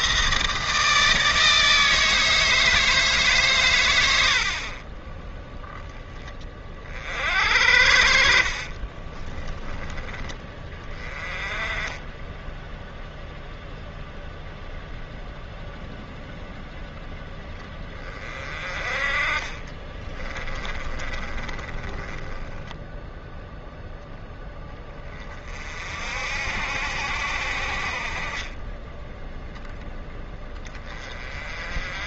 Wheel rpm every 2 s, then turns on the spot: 160, 160, 50, 40, 50, 20, 0, 0, 0, 30, 30, 10, 20, 70, 20, 20.
8-10 20-24 28-30